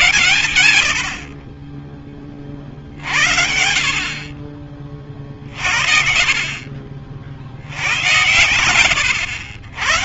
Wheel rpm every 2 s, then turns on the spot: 40, 50, 50, 110, 160.
2-4